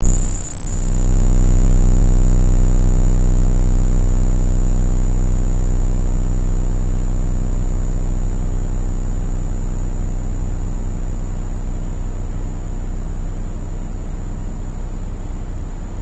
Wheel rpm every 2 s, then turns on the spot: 0, 0, 0, 0, 0, 0, 0, 0.
none